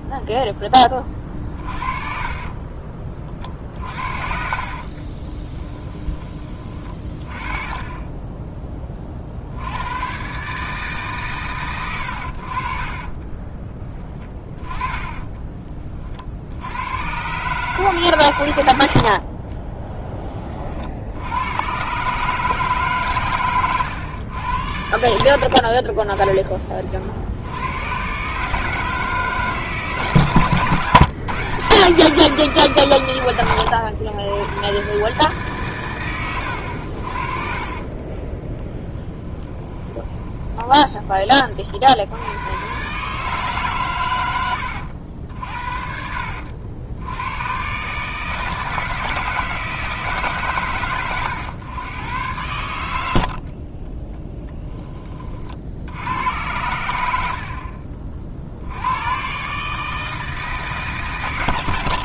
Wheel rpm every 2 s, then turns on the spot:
20, 30, 60, 30, 10, 140, 50, 10, 80, 90, 40, 150, 90, 30, 150, 140, 150, 100, 80, 20, 20, 120, 90, 70, 160, 110, 110, 10, 100, 70, 160.
2-6 14-16 38-42